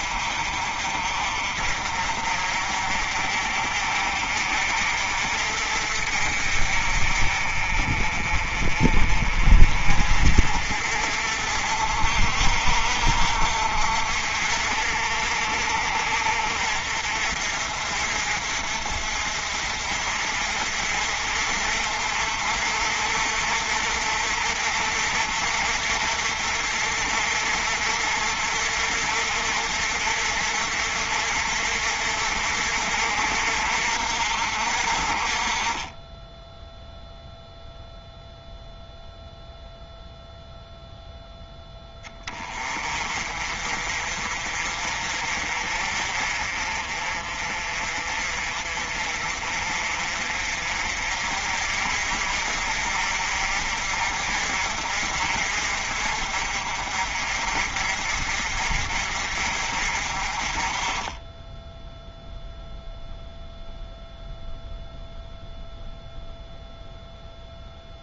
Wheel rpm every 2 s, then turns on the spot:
50, 50, 50, 50, 40, 50, 60, 60, 50, 50, 50, 50, 60, 60, 60, 60, 60, 50, 0, 0, 0, 30, 40, 40, 40, 50, 50, 50, 50, 50, 30, 0, 0, 0.
none